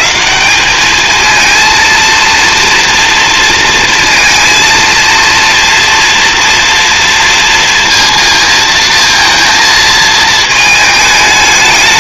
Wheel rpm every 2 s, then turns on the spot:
210, 240, 230, 230, 220, 220.
none